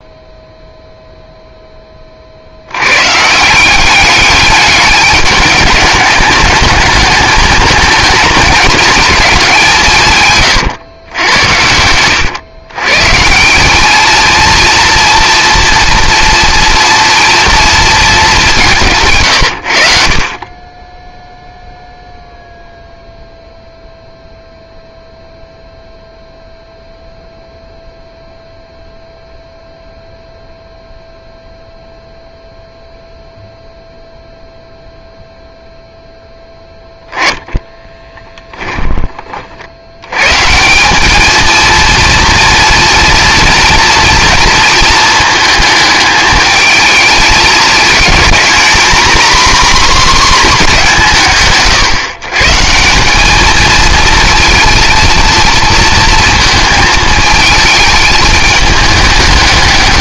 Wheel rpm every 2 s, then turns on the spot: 0, 90, 210, 210, 220, 130, 130, 230, 230, 180, 20, 0, 0, 0, 0, 0, 0, 0, 0, 10, 160, 230, 220, 220, 230, 210, 160, 220, 220, 210.
none